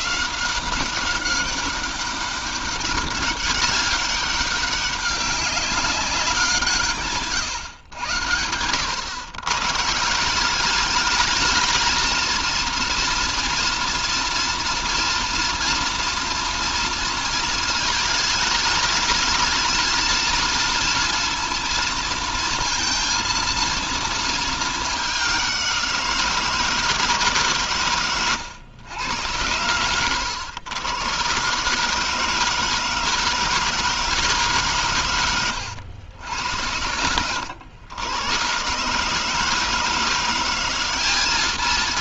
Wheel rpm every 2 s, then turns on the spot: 190, 200, 200, 150, 110, 210, 230, 230, 230, 220, 230, 230, 200, 160, 100, 120, 160, 120, 100, 150, 200.
none